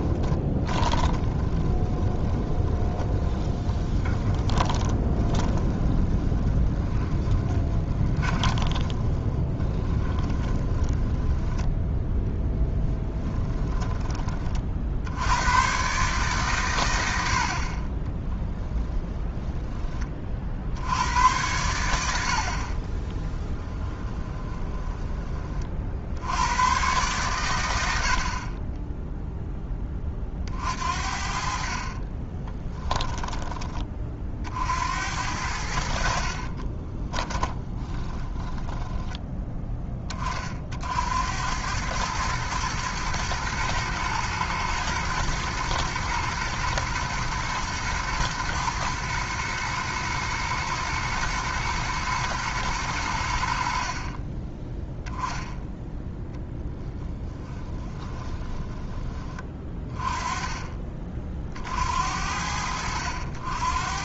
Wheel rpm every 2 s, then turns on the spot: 20, 20, 20, 20, 40, 10, 20, 70, 80, 20, 90, 20, 20, 110, 0, 50, 10, 80, 10, 10, 70, 110, 110, 110, 120, 110, 80, 0, 20, 20, 40, 80.
0-14 18-20 22-24 32-34 36-38 56-58